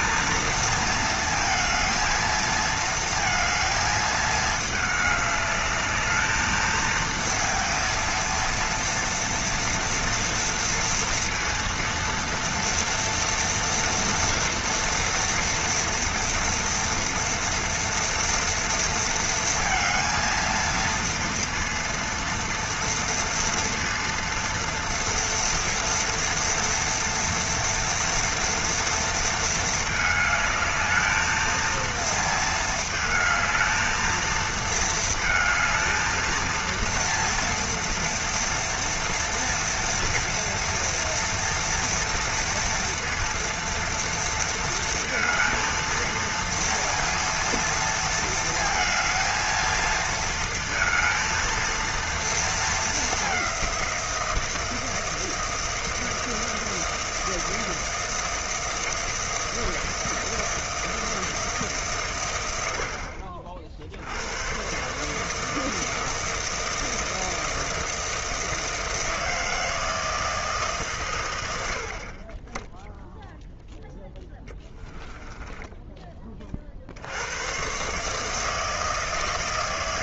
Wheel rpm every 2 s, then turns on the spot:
230, 220, 210, 220, 230, 230, 230, 230, 230, 230, 230, 230, 230, 240, 230, 220, 220, 220, 230, 230, 230, 230, 230, 230, 220, 230, 210, 160, 160, 160, 160, 60, 130, 160, 160, 140, 10, 10, 70, 160.
74-76